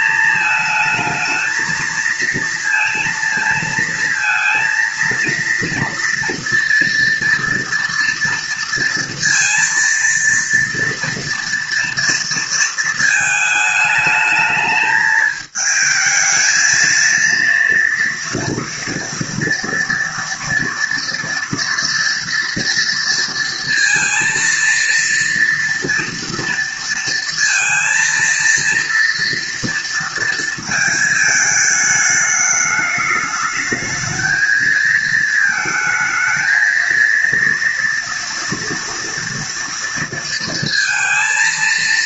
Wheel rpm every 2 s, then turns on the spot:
220, 230, 230, 230, 230, 230, 230, 220, 220, 230, 230, 230, 230, 230, 230, 230, 210, 220, 230, 230, 230.
none